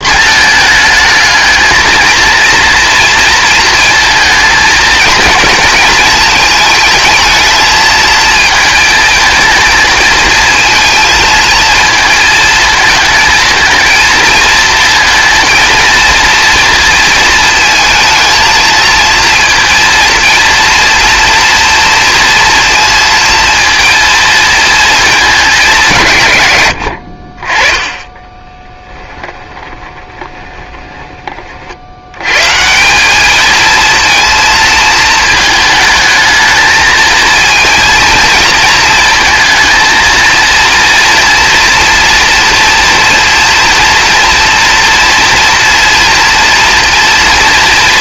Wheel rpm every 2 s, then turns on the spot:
220, 230, 230, 220, 220, 230, 220, 230, 230, 230, 230, 230, 220, 90, 10, 20, 180, 230, 220, 220, 230, 230, 240, 230.
28-32